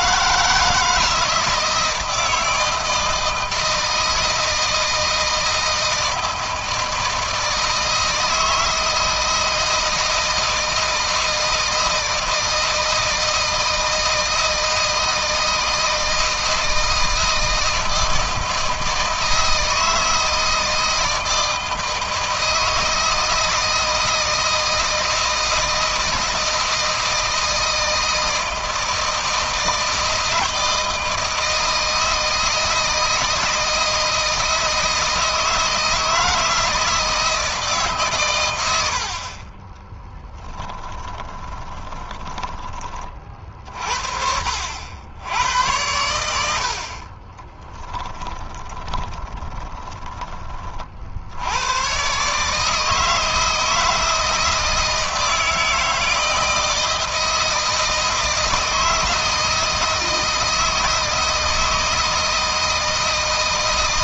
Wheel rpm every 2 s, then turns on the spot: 160, 160, 160, 160, 160, 160, 160, 160, 160, 160, 160, 160, 160, 160, 160, 160, 160, 160, 160, 80, 20, 30, 80, 40, 10, 50, 160, 160, 160, 160, 160, 160.
38-42 46-50